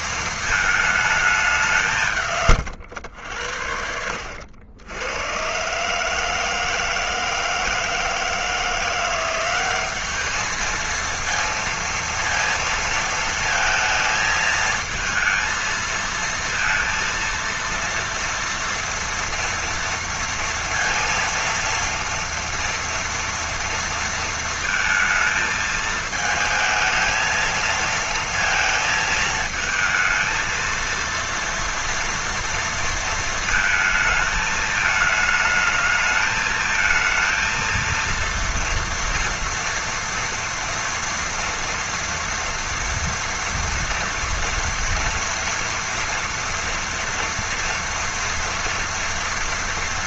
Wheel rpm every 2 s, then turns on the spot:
220, 120, 90, 160, 170, 220, 230, 220, 230, 230, 230, 230, 230, 220, 230, 230, 230, 220, 220, 230, 230, 230, 240, 230, 230.
none